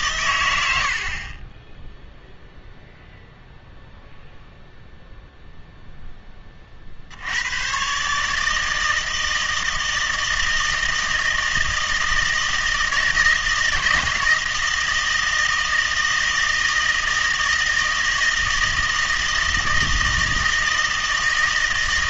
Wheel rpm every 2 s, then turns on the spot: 90, 0, 0, 30, 160, 160, 160, 160, 160, 160, 160.
none